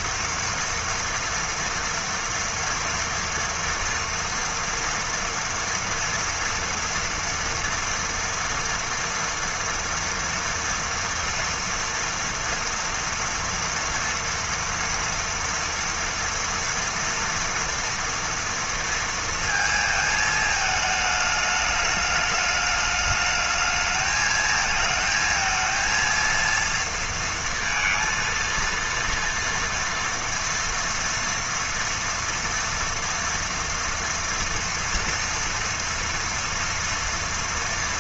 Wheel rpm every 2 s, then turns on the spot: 230, 230, 230, 230, 230, 230, 230, 230, 230, 230, 220, 210, 220, 230, 230, 230, 230, 230, 230.
none